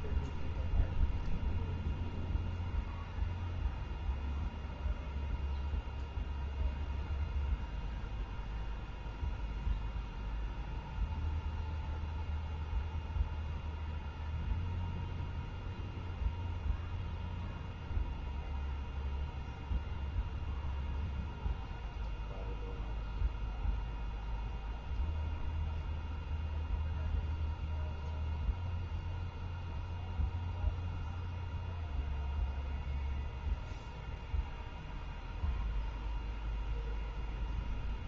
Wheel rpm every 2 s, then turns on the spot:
0, 0, 0, 0, 0, 0, 0, 0, 0, 0, 0, 0, 0, 0, 0, 0, 0, 0, 0.
none